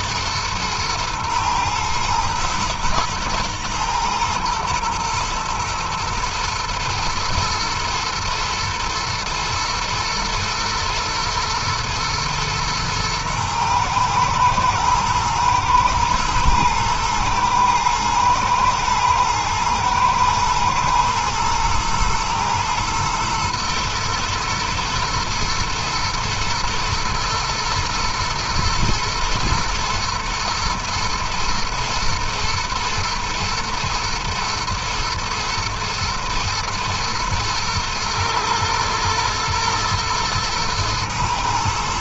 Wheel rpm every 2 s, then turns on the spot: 120, 110, 110, 120, 120, 110, 120, 120, 120, 110, 110, 110, 110, 110, 110, 120, 120, 120, 110, 110, 110.
none